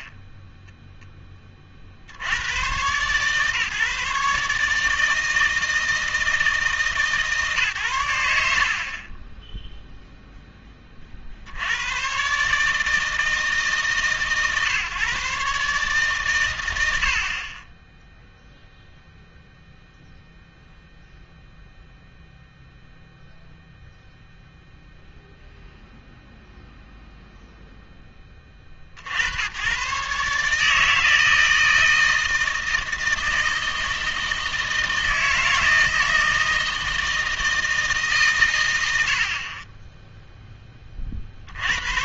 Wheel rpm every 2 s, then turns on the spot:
10, 130, 150, 160, 80, 20, 160, 140, 100, 0, 0, 0, 0, 0, 60, 150, 160, 160, 160, 100, 20.
0-2